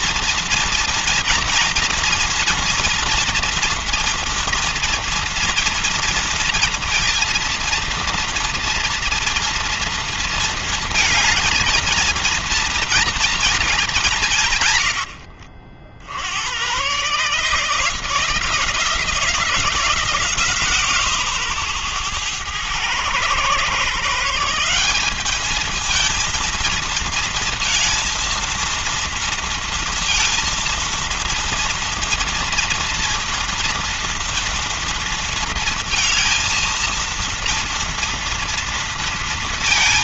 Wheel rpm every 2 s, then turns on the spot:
230, 230, 230, 230, 230, 220, 230, 190, 70, 160, 160, 110, 170, 230, 230, 230, 230, 230, 230, 230.
none